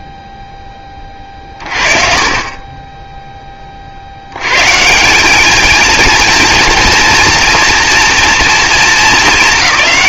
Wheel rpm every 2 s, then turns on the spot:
10, 30, 120, 230, 230.
none